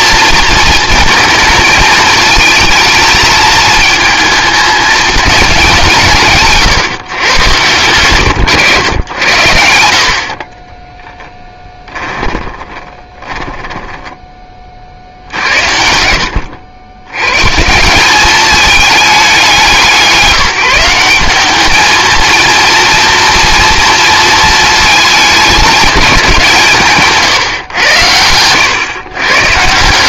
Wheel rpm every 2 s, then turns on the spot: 220, 220, 220, 130, 100, 20, 20, 60, 90, 210, 180, 230, 210, 150, 120.
10-14